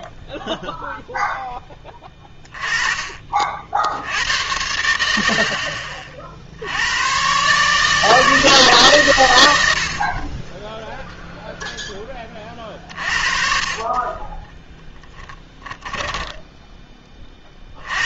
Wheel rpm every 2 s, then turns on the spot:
0, 20, 90, 80, 140, 0, 40, 10, 10.
none